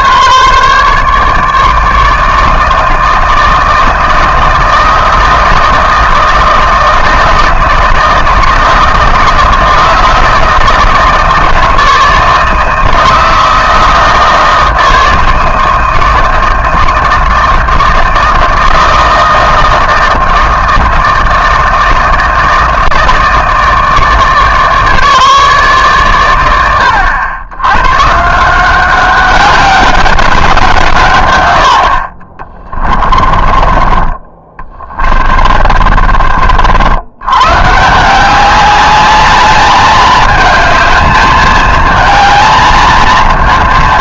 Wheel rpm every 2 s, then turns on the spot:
150, 160, 160, 160, 160, 160, 160, 160, 160, 160, 160, 160, 150, 100, 180, 180, 20, 20, 60, 200, 220, 230.
32-36